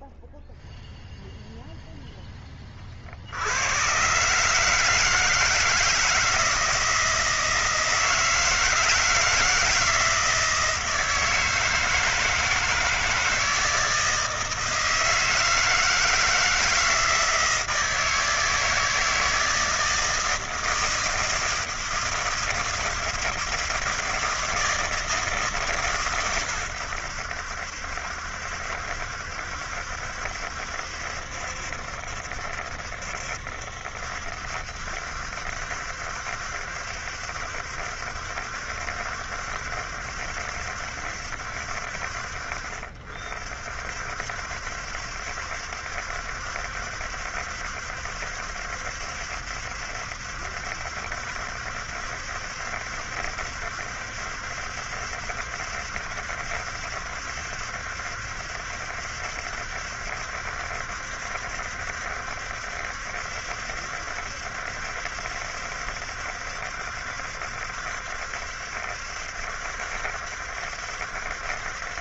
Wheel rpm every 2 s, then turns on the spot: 0, 10, 150, 160, 160, 160, 160, 160, 160, 160, 160, 160, 160, 120, 70, 70, 70, 70, 70, 70, 70, 50, 70, 70, 70, 70, 70, 70, 70, 70, 70, 70, 70, 70, 70, 70.
none